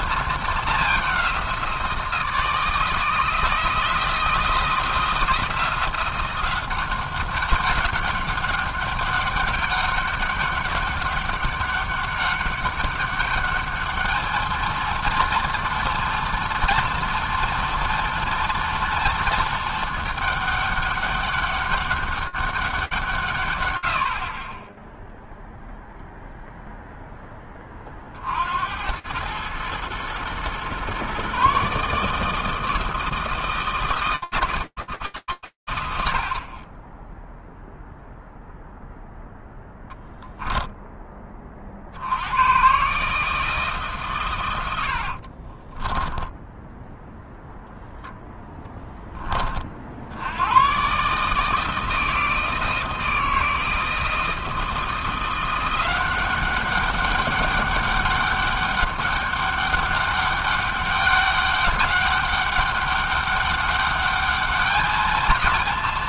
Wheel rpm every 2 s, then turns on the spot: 180, 160, 170, 190, 200, 200, 210, 230, 230, 220, 200, 120, 0, 20, 110, 150, 160, 90, 0, 0, 30, 160, 50, 0, 20, 150, 160, 180, 200, 200, 200, 200, 220.
44-46